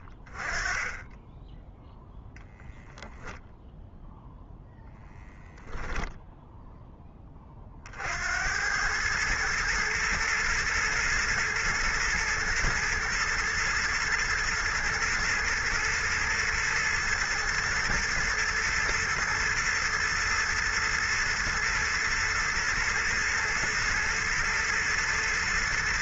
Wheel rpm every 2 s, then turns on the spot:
10, 0, 0, 40, 110, 110, 120, 120, 110, 120, 110, 110, 110.
none